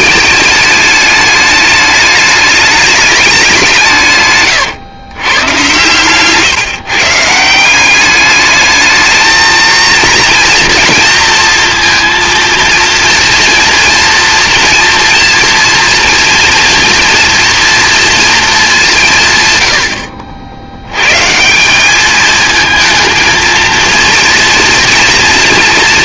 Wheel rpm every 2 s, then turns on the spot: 210, 210, 130, 150, 210, 230, 230, 240, 230, 210, 100, 230, 230.
none